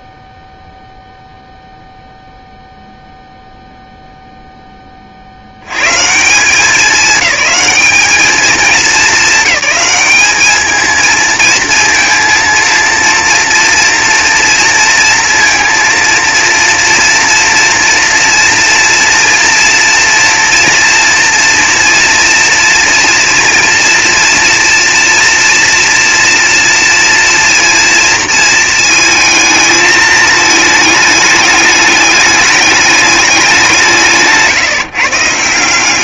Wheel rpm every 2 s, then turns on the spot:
0, 0, 140, 210, 210, 230, 230, 230, 230, 230, 230, 240, 230, 230, 220, 210, 170, 130.
none